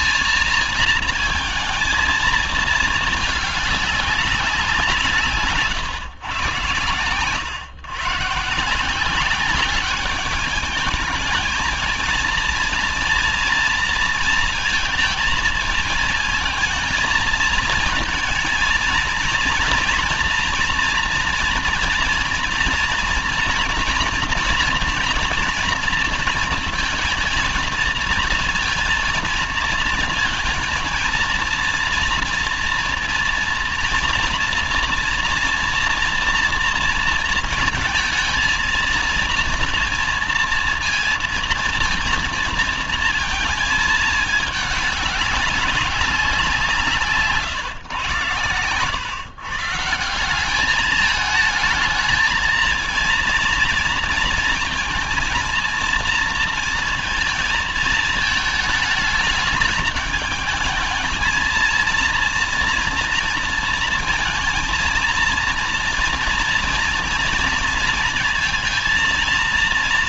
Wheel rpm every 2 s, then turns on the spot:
230, 220, 160, 120, 180, 220, 230, 230, 230, 230, 230, 230, 230, 230, 230, 230, 230, 230, 230, 230, 230, 230, 200, 150, 140, 220, 230, 230, 230, 220, 220, 230, 230, 230, 230.
none